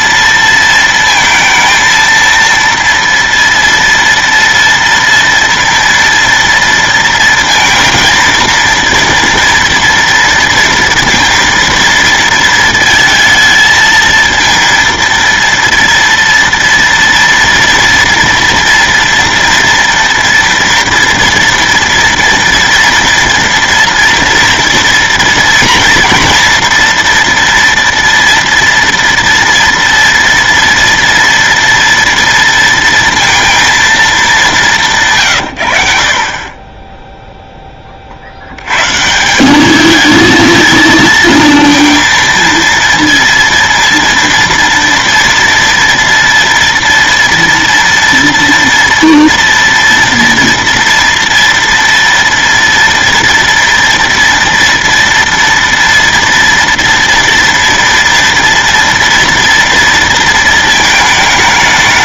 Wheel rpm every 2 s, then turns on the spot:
230, 230, 230, 230, 230, 230, 230, 230, 230, 230, 230, 240, 230, 230, 230, 230, 230, 180, 20, 120, 230, 230, 230, 230, 230, 230, 230, 230, 230, 230, 220.
none